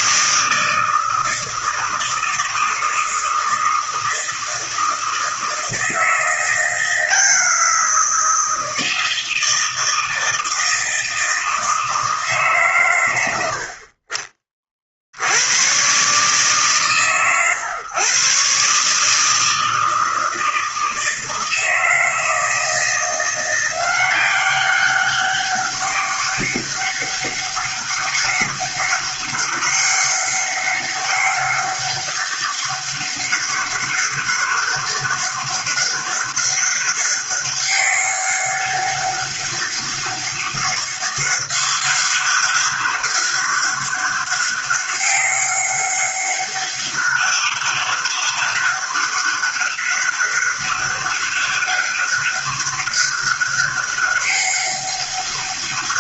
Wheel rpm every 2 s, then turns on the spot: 160, 160, 160, 170, 170, 160, 140, 40, 130, 140, 160, 160, 190, 200, 200, 190, 200, 200, 200, 200, 200, 200, 190, 200, 200, 200, 200, 200.
none